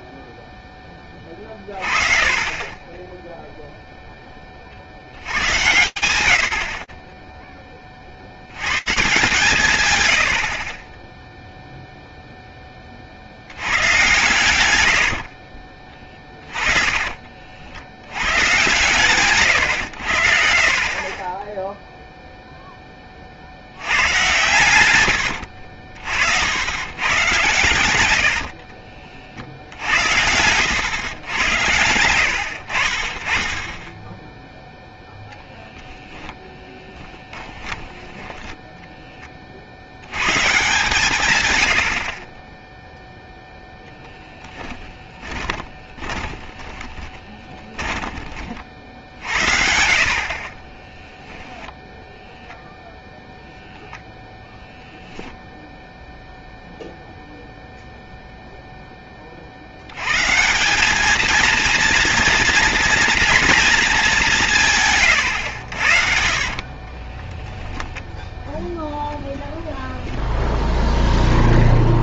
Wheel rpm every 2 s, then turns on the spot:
0, 20, 90, 40, 140, 10, 40, 70, 30, 130, 20, 30, 90, 120, 60, 110, 40, 0, 10, 10, 140, 0, 10, 20, 60, 20, 0, 0, 0, 0, 200, 240, 150, 30, 0, 0.
14-18 20-22 36-38 44-48 50-52 64-68